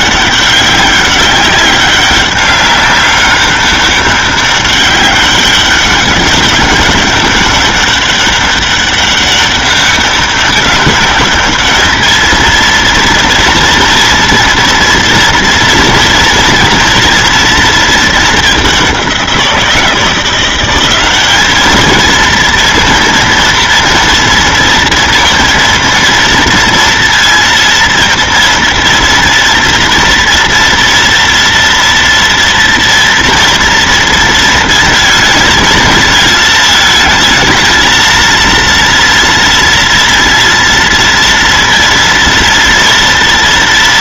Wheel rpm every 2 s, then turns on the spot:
190, 200, 200, 200, 200, 200, 220, 230, 230, 220, 180, 230, 230, 230, 230, 230, 230, 230, 220, 230, 230, 230.
none